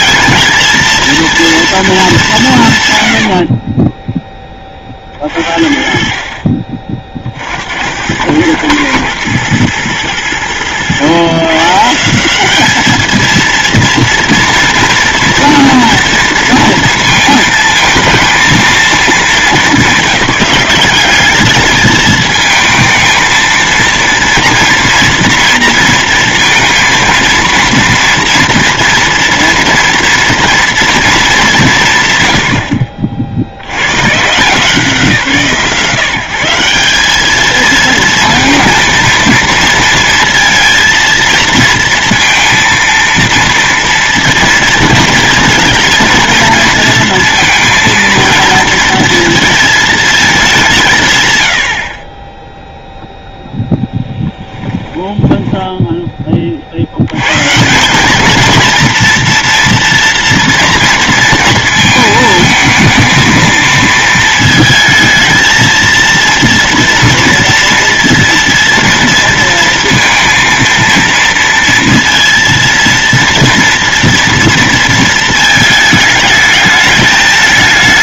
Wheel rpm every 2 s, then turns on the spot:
230, 80, 30, 40, 110, 110, 210, 230, 230, 220, 190, 220, 230, 230, 230, 230, 70, 150, 190, 230, 230, 230, 230, 230, 230, 170, 0, 20, 80, 230, 230, 230, 220, 230, 230, 230, 230, 230, 210.
54-56